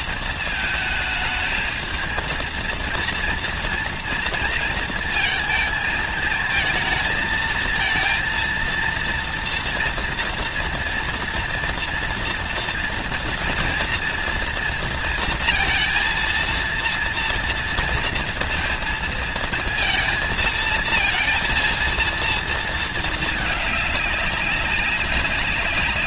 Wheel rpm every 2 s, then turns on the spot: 220, 230, 230, 220, 230, 230, 230, 230, 230, 230, 230, 230, 200.
none